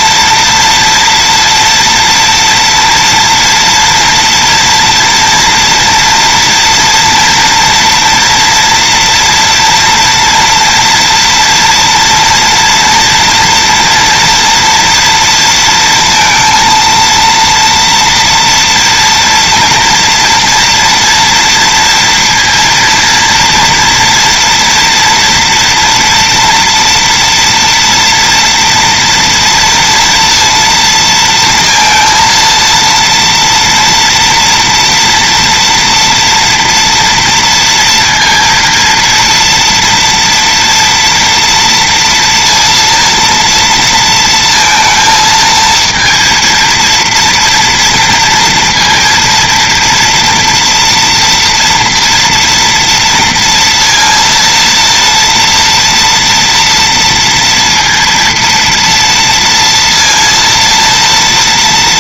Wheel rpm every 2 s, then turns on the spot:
230, 230, 230, 240, 230, 240, 230, 230, 230, 230, 230, 230, 230, 230, 230, 230, 230, 230, 240, 230, 240, 230, 230, 230, 230, 230, 230, 230, 230, 230, 230.
none